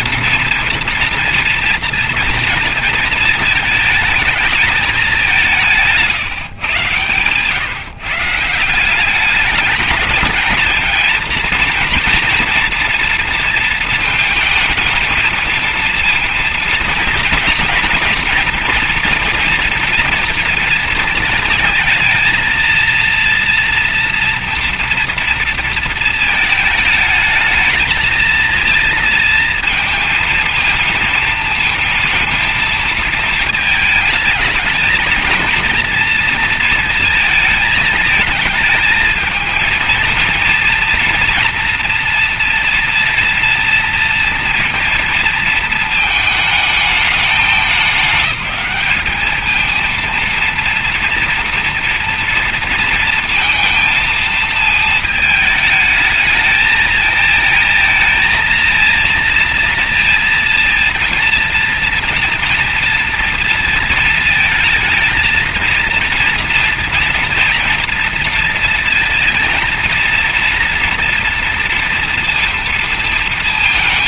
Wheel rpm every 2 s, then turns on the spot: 230, 230, 220, 130, 170, 220, 230, 220, 230, 230, 230, 230, 230, 220, 220, 230, 230, 220, 230, 220, 230, 230, 230, 220, 210, 230, 230, 220, 220, 230, 230, 230, 220, 230, 230, 230, 230.
none